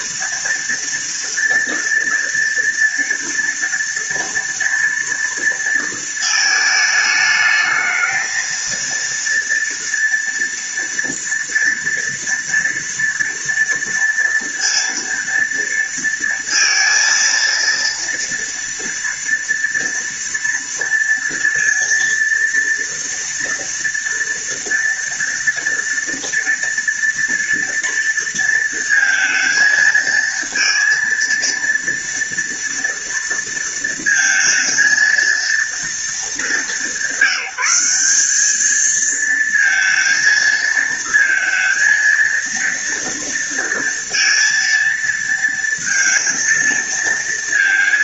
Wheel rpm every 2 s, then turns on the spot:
230, 230, 230, 220, 230, 230, 230, 230, 230, 230, 230, 230, 230, 230, 230, 230, 230, 230, 200, 220, 230, 230, 230, 230.
none